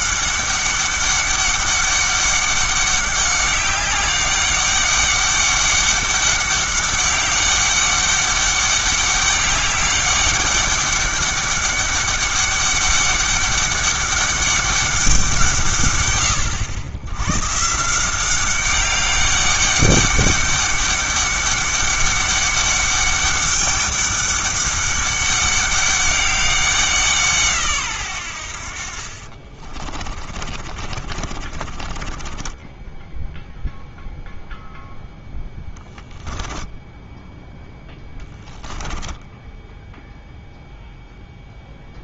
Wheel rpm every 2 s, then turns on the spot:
200, 200, 200, 200, 200, 200, 200, 200, 100, 190, 200, 200, 200, 180, 50, 40, 0, 0, 10, 10, 0.
28-32 36-38